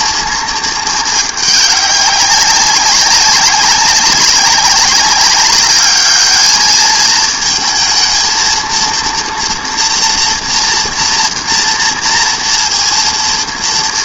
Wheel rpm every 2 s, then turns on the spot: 230, 190, 200, 220, 230, 230, 230.
none